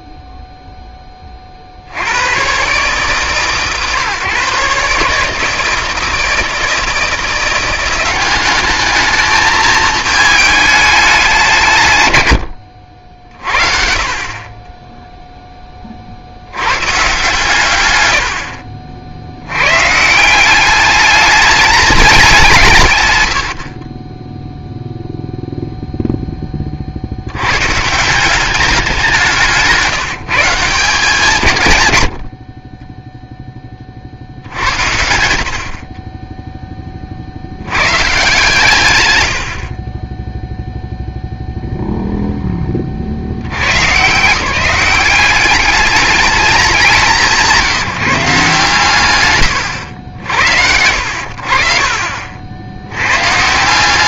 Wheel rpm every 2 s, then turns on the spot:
0, 130, 140, 160, 200, 210, 80, 30, 110, 30, 190, 160, 0, 30, 200, 170, 40, 70, 10, 120, 0, 10, 170, 190, 130, 80, 90.
none